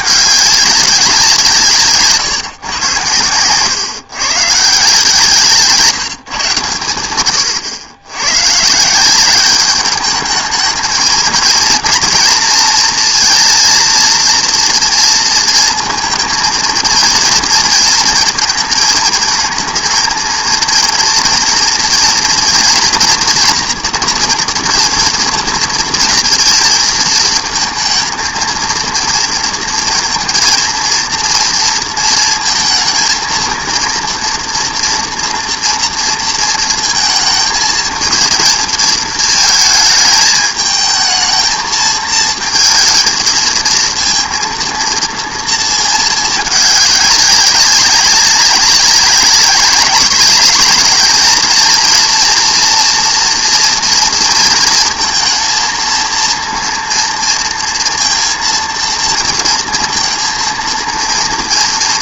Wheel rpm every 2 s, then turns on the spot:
200, 130, 150, 120, 140, 220, 240, 230, 220, 220, 230, 240, 230, 220, 230, 230, 230, 240, 230, 220, 210, 230, 230, 210, 190, 210, 230, 230, 230, 230, 230.
none